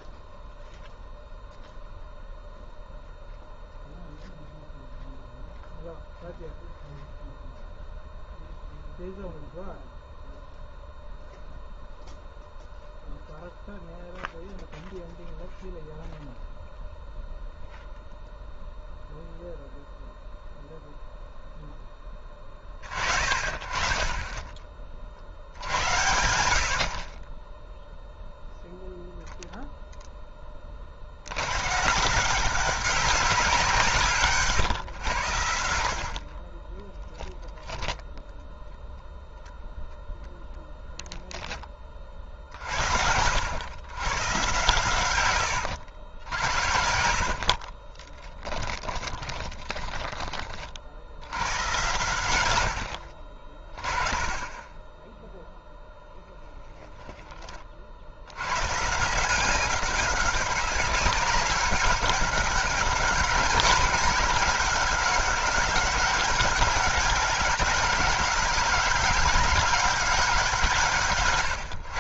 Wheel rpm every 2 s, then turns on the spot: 0, 0, 0, 0, 0, 0, 0, 0, 0, 0, 0, 30, 30, 70, 0, 30, 190, 140, 20, 0, 0, 60, 120, 70, 20, 40, 90, 20, 10, 120, 200, 200, 190, 190, 190, 170.
46-50